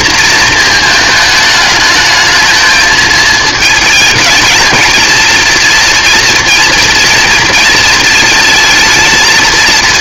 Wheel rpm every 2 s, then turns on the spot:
230, 220, 220, 230, 230.
none